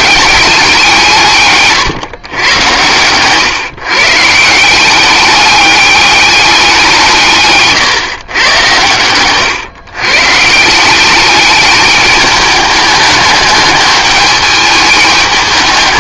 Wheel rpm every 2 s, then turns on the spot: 190, 110, 170, 190, 120, 160, 210, 210.
none